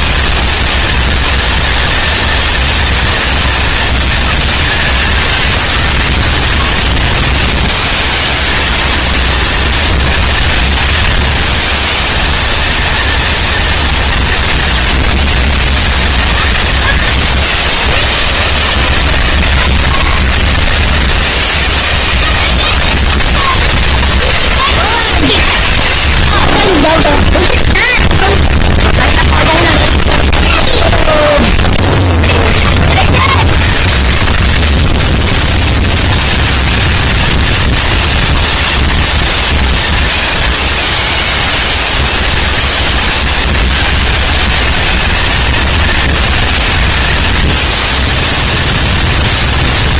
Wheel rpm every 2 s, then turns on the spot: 230, 230, 230, 230, 220, 220, 230, 230, 220, 170, 160, 160, 140, 40, 10, 20, 20, 130, 220, 230, 230, 220, 220, 230, 220.
28-34